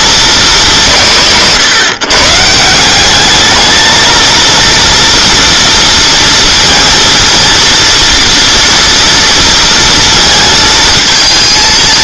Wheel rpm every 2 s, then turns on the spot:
190, 160, 230, 230, 240, 230.
none